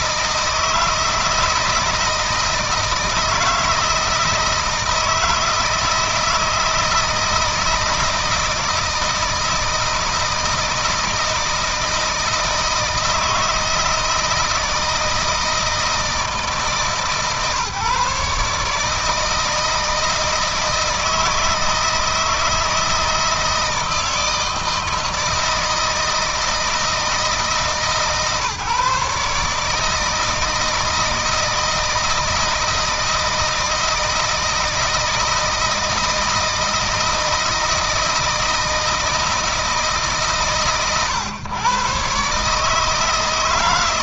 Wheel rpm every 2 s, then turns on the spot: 160, 160, 160, 160, 160, 160, 160, 160, 150, 160, 160, 160, 160, 160, 150, 160, 160, 160, 160, 160, 130, 160.
none